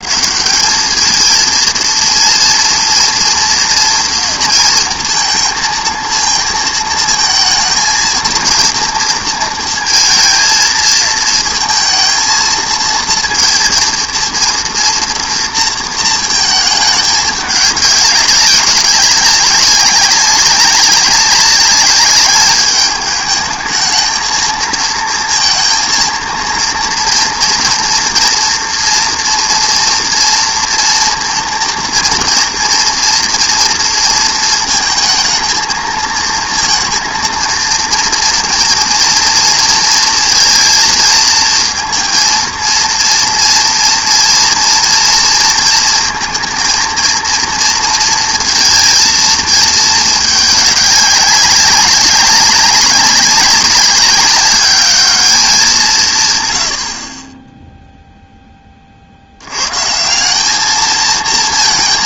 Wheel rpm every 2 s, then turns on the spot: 210, 230, 230, 230, 230, 230, 230, 230, 220, 190, 190, 210, 230, 230, 240, 230, 230, 220, 230, 230, 230, 230, 230, 230, 230, 210, 190, 210, 90, 20, 210.
none